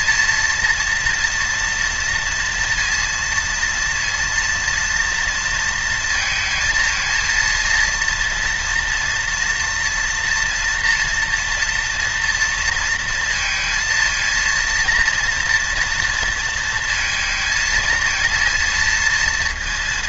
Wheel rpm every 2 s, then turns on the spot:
230, 230, 230, 230, 230, 240, 230, 230, 230, 230.
none